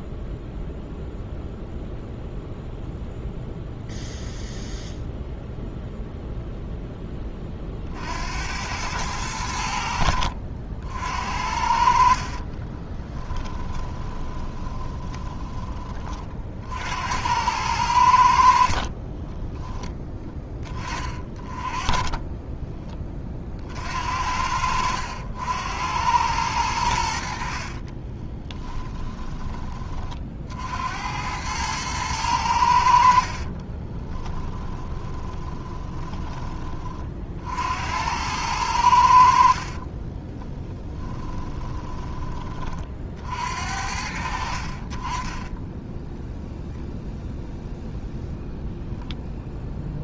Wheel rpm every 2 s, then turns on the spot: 0, 0, 0, 10, 100, 60, 20, 30, 60, 40, 20, 20, 80, 90, 30, 70, 70, 10, 30, 80, 10, 50, 40, 0, 0.
12-16 18-20 28-30 34-36 40-42